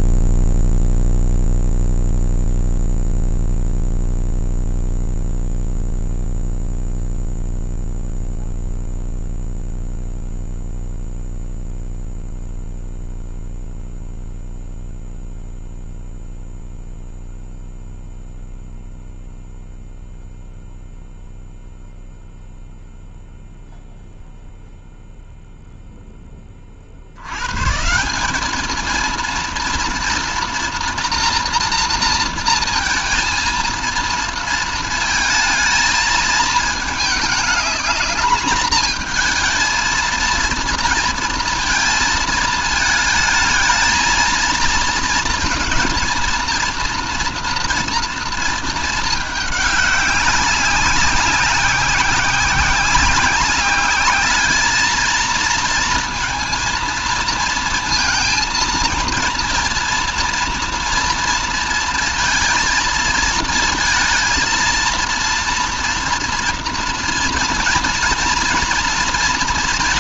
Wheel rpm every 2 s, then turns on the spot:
0, 0, 0, 0, 0, 0, 0, 0, 0, 0, 0, 0, 0, 50, 220, 230, 230, 230, 210, 220, 230, 220, 230, 230, 220, 190, 190, 210, 230, 230, 230, 230, 230, 230, 230.
none